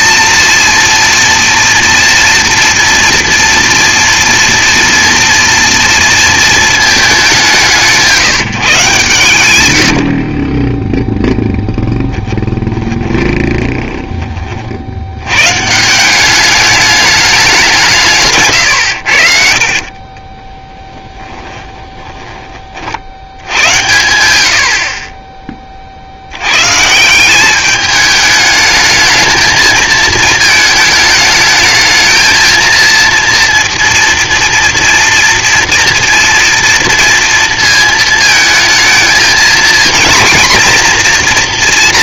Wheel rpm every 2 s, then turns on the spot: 230, 240, 230, 230, 160, 30, 10, 30, 200, 120, 20, 30, 60, 120, 220, 220, 230, 230, 230, 220, 230.
12-14 18-22